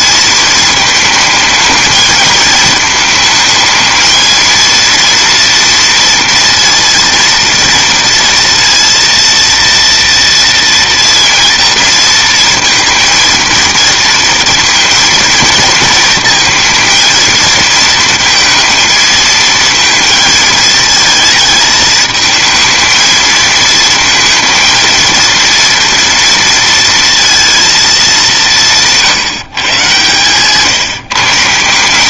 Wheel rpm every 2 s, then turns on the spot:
220, 220, 230, 230, 230, 230, 230, 230, 230, 230, 220, 220, 230, 230, 170, 150.
none